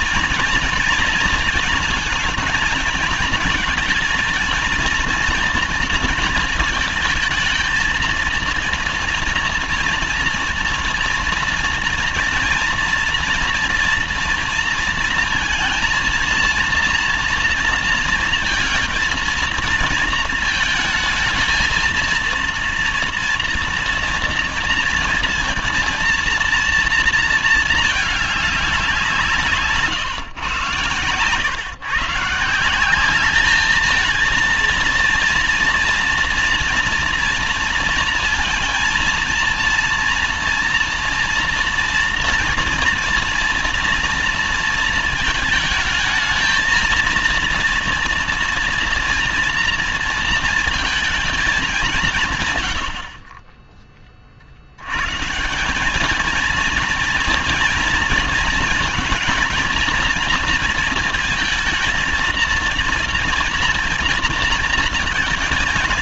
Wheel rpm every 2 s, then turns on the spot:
230, 230, 230, 220, 230, 240, 230, 230, 230, 220, 230, 230, 230, 230, 190, 120, 180, 230, 230, 230, 230, 230, 230, 230, 230, 230, 110, 90, 230, 230, 230, 230, 230.
none